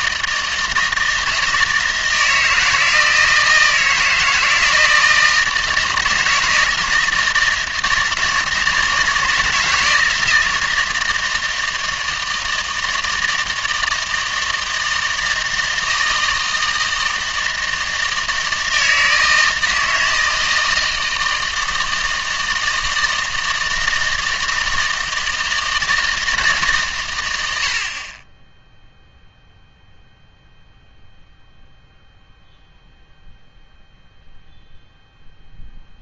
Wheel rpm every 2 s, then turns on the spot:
160, 160, 160, 160, 160, 160, 160, 160, 160, 160, 160, 160, 160, 140, 10, 0, 0, 0.
none